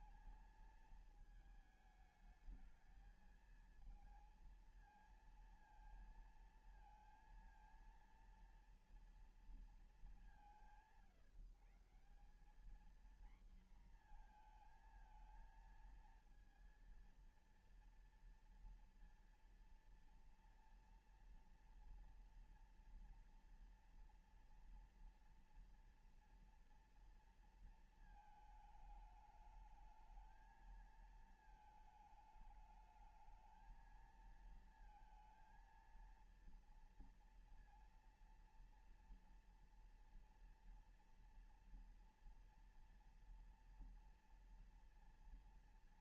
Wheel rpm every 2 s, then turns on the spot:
220, 220, 230, 230, 230, 140, 210, 230, 230, 230, 230, 230, 230, 230, 220, 220, 220, 230, 230, 240, 230, 230, 230.
none